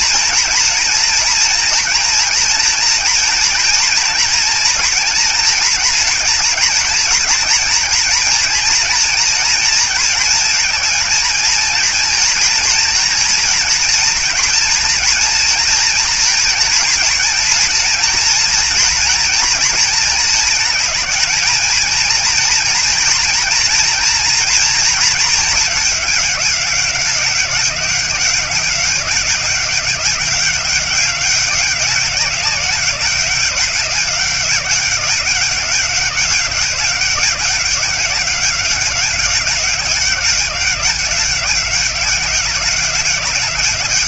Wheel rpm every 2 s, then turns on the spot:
230, 230, 230, 230, 230, 220, 230, 240, 230, 230, 220, 230, 230, 200, 190, 200, 190, 190, 190, 190, 190, 190.
none